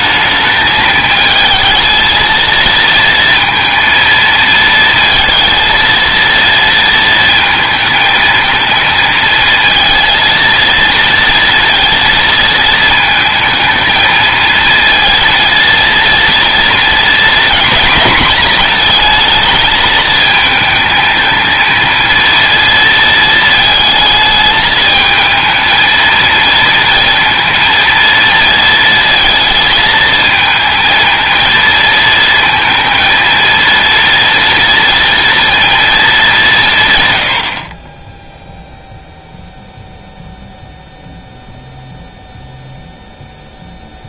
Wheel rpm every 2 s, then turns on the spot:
220, 230, 230, 230, 220, 230, 230, 230, 230, 220, 220, 230, 220, 230, 230, 230, 230, 230, 160, 0, 0, 0.
none